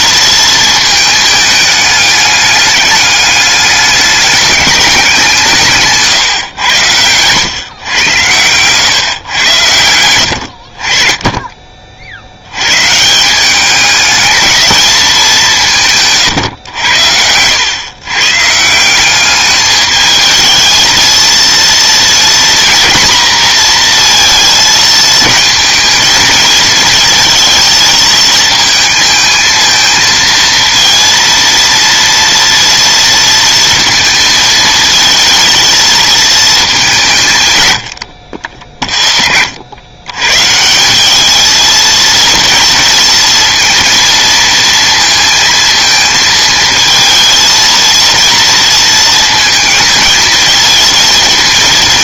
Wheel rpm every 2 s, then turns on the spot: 220, 200, 200, 120, 120, 50, 120, 220, 120, 170, 220, 230, 220, 220, 220, 230, 230, 220, 200, 60, 170, 230, 230, 220, 230, 220.
none